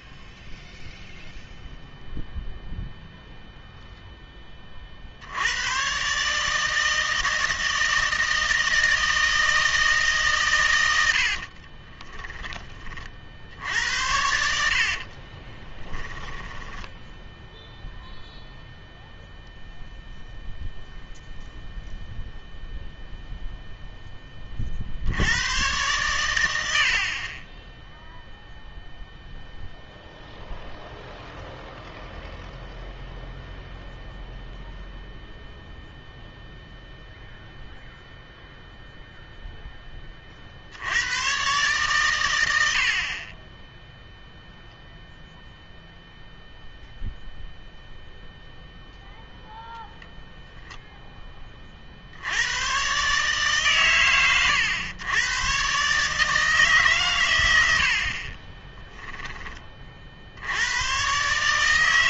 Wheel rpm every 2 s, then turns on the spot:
0, 0, 30, 160, 160, 110, 20, 70, 10, 0, 0, 0, 40, 80, 0, 0, 0, 0, 0, 0, 70, 90, 0, 0, 0, 0, 110, 100, 150, 20, 100.
16-18 58-60